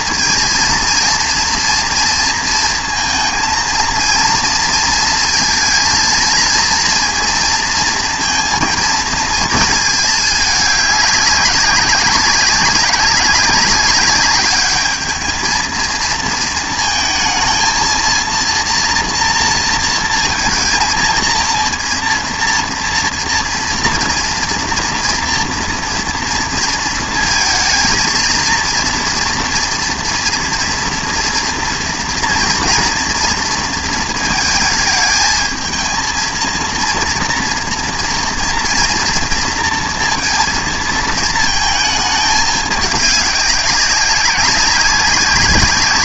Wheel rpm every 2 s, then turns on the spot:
230, 230, 230, 230, 230, 210, 200, 210, 230, 230, 230, 230, 230, 220, 230, 230, 230, 220, 230, 230, 230, 210, 200.
none